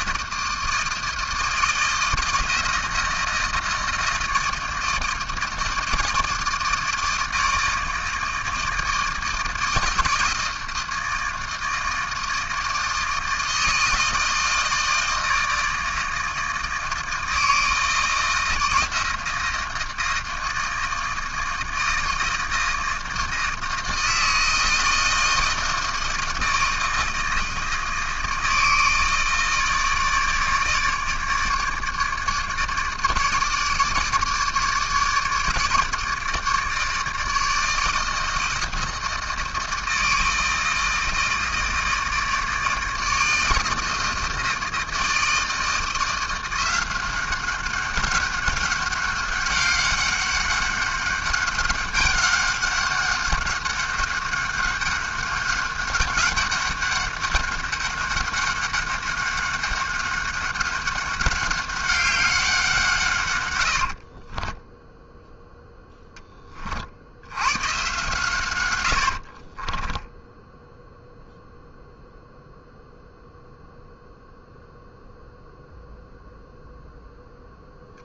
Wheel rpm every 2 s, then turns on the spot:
160, 160, 160, 160, 160, 160, 160, 160, 160, 160, 160, 160, 160, 160, 160, 150, 150, 150, 150, 160, 160, 160, 160, 180, 190, 200, 200, 200, 200, 200, 190, 180, 20, 40, 100, 0, 0, 0, 0.
64-66